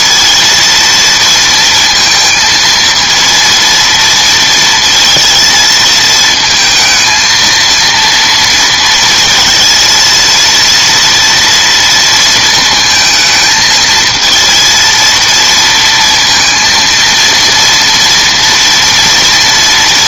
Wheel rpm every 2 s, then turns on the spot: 230, 230, 230, 220, 230, 230, 230, 230, 230, 240.
none